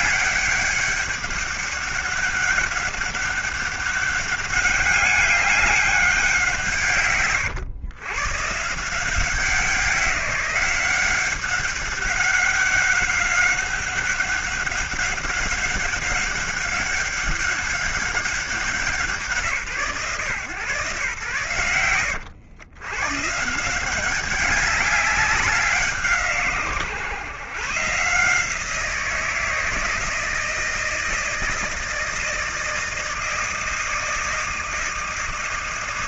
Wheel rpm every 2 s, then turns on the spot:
200, 200, 200, 170, 140, 180, 190, 190, 200, 190, 120, 100, 200, 130, 170, 160, 160, 160.
none